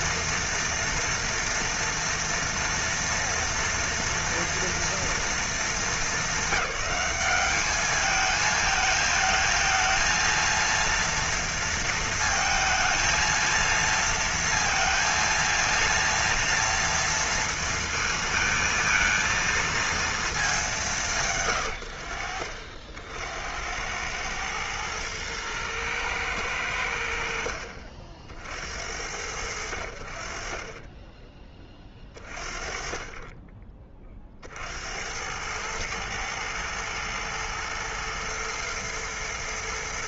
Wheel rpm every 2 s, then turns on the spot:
240, 230, 230, 210, 220, 230, 220, 230, 230, 230, 160, 60, 110, 90, 70, 10, 30, 80, 110, 110.
none